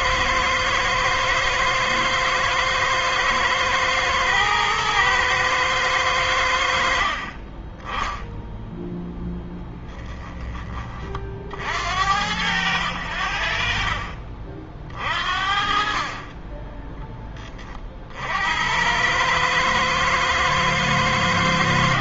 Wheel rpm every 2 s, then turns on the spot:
110, 110, 120, 80, 0, 20, 80, 50, 30, 70, 110.
16-18